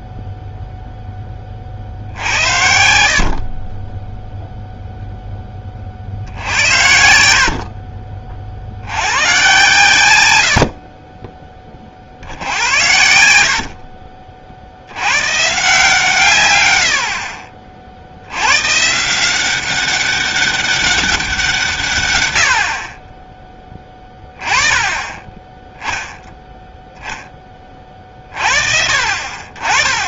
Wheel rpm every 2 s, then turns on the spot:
0, 70, 0, 60, 60, 80, 70, 60, 130, 120, 200, 80, 20, 10, 50.
2-4